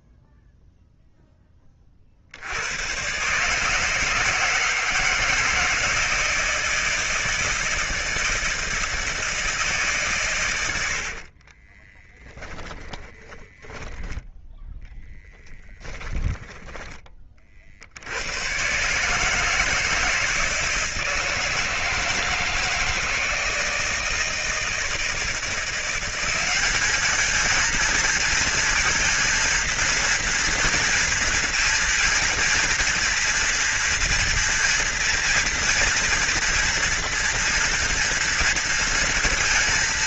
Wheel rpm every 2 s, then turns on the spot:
0, 70, 160, 160, 160, 120, 10, 10, 10, 100, 160, 160, 160, 190, 230, 230, 230, 230, 230, 230.
12-14 16-18